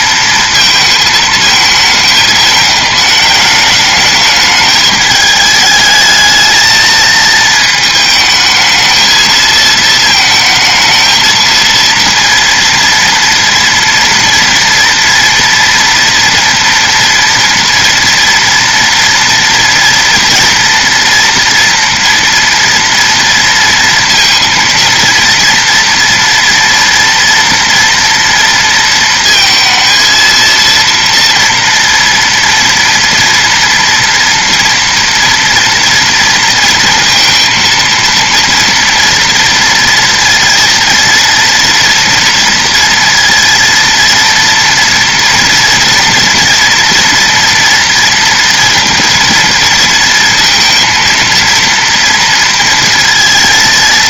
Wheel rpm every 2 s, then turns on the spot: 220, 210, 210, 220, 220, 220, 230, 240, 230, 230, 240, 230, 230, 230, 230, 230, 230, 230, 230, 230, 230, 230, 240, 240, 230, 230, 230.
none